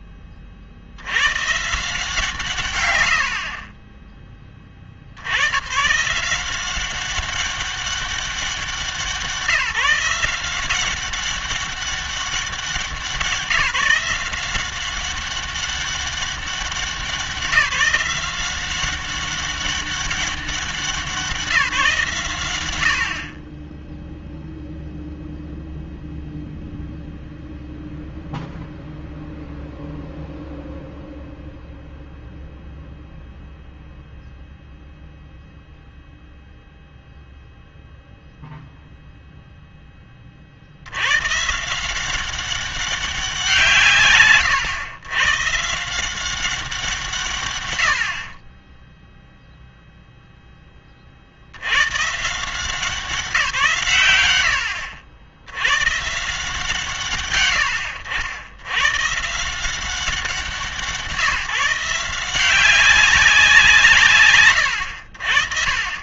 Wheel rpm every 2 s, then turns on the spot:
40, 90, 30, 190, 180, 180, 190, 180, 190, 180, 180, 90, 0, 0, 0, 0, 0, 0, 0, 0, 70, 190, 120, 180, 10, 10, 170, 80, 150, 100, 160, 180, 110.
none